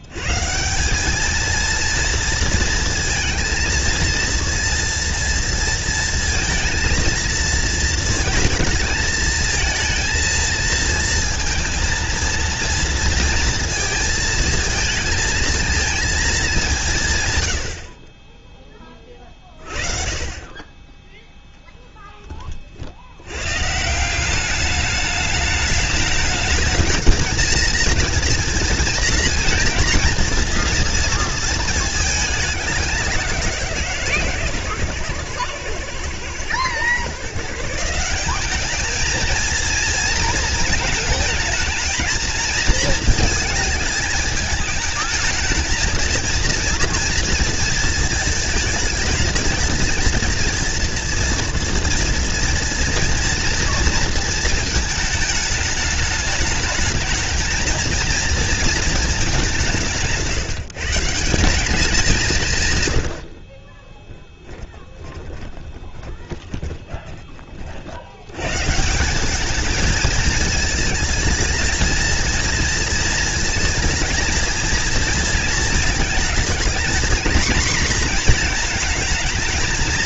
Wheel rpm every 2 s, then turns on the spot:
170, 230, 230, 230, 220, 230, 230, 220, 190, 20, 20, 50, 200, 210, 230, 230, 200, 130, 120, 210, 220, 230, 210, 230, 220, 230, 230, 220, 220, 230, 150, 130, 20, 20, 150, 220, 230, 230, 230, 230.
64-68